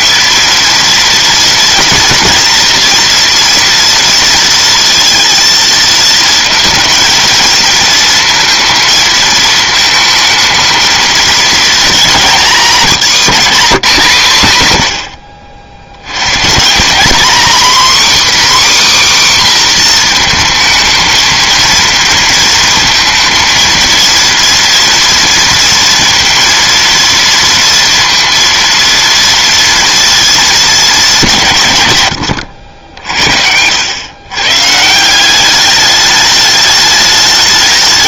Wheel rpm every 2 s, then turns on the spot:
230, 230, 230, 230, 230, 220, 190, 90, 190, 280, 220, 230, 230, 230, 230, 200, 80, 160, 210.
none